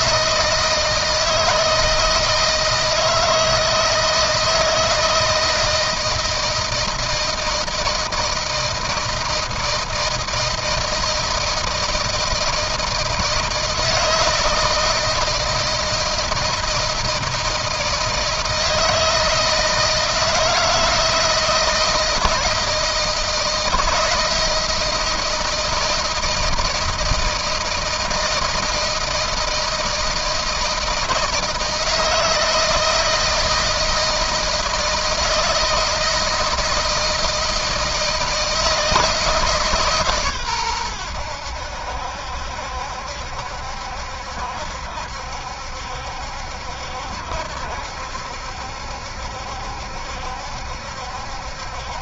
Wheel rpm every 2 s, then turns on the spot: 160, 160, 160, 160, 160, 160, 160, 160, 160, 160, 170, 160, 160, 160, 160, 160, 160, 160, 170, 160, 110, 70, 70, 70, 70, 70.
none